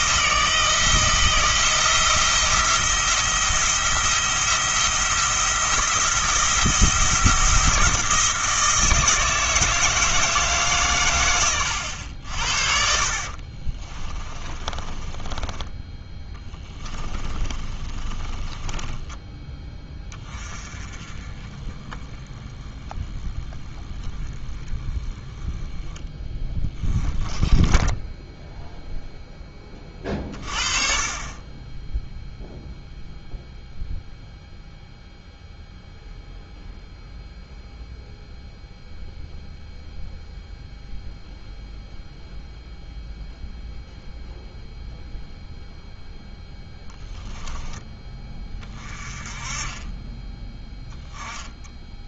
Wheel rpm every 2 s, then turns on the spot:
160, 170, 170, 170, 160, 140, 50, 20, 20, 20, 20, 10, 10, 10, 0, 40, 0, 0, 0, 0, 0, 0, 0, 0, 20, 10.
12-20